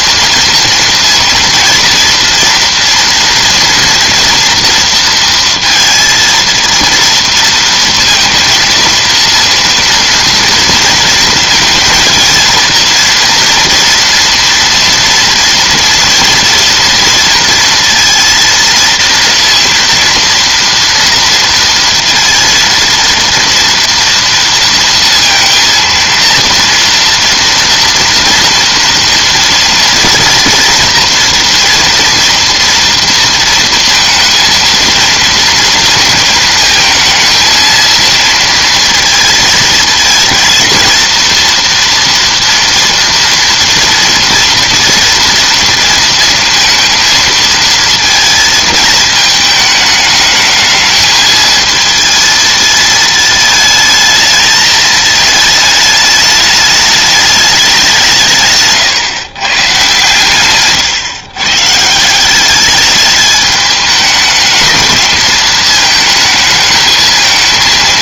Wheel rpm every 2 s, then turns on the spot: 230, 230, 230, 230, 230, 230, 230, 230, 230, 230, 230, 230, 230, 240, 240, 240, 230, 230, 220, 230, 230, 230, 230, 230, 220, 220, 220, 220, 210, 140, 130, 210, 210, 220.
none